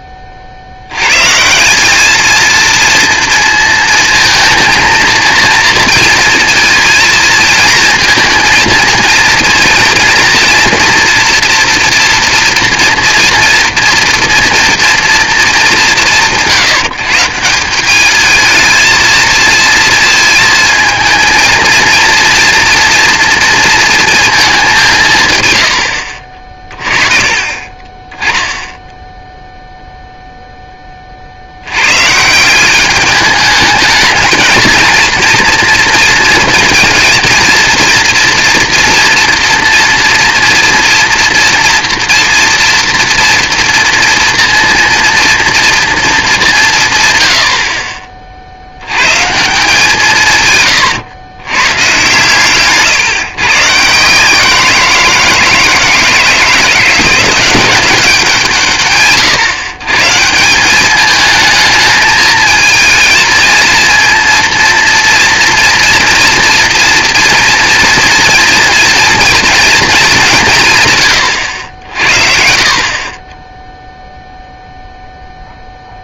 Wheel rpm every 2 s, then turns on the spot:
60, 230, 220, 230, 230, 240, 230, 230, 170, 230, 220, 230, 200, 30, 10, 10, 190, 230, 230, 230, 230, 230, 230, 160, 80, 120, 140, 170, 160, 150, 180, 220, 230, 230, 230, 170, 50, 0.
50-52